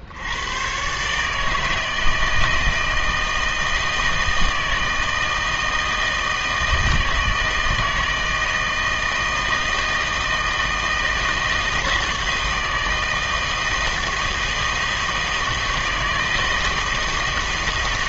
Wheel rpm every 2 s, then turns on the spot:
110, 160, 160, 160, 160, 160, 160, 160, 160.
none